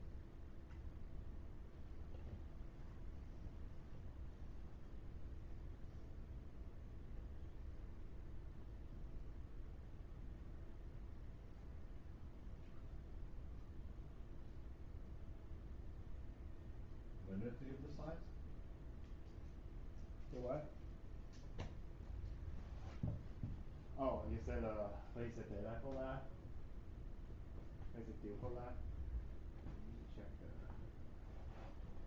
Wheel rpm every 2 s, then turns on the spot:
0, 0, 0, 0, 0, 0, 0, 0, 0, 0, 0, 0, 0, 0, 0, 0.
none